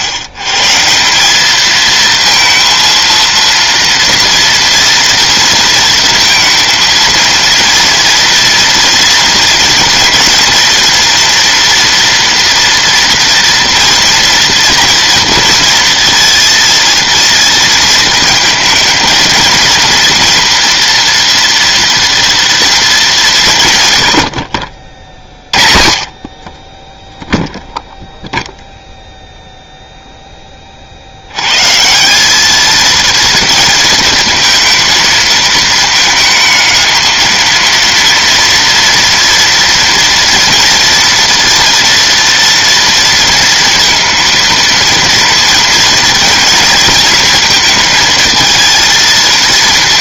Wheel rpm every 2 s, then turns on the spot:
140, 230, 230, 230, 230, 230, 230, 230, 230, 220, 240, 230, 70, 30, 0, 20, 200, 230, 220, 230, 230, 230, 230, 230, 220.
none